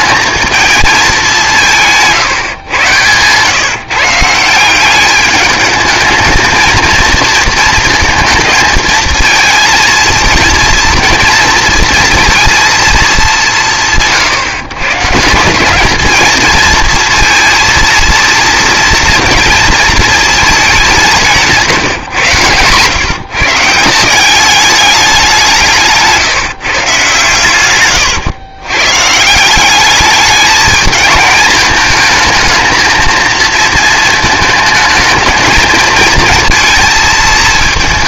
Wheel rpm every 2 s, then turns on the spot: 220, 130, 180, 230, 230, 230, 230, 150, 230, 230, 200, 140, 210, 150, 120, 220, 230, 220, 230.
2-4